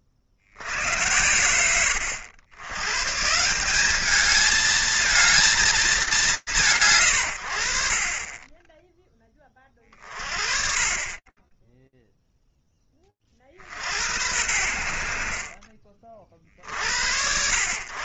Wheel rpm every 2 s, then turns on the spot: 40, 80, 210, 170, 30, 30, 10, 70, 60.
none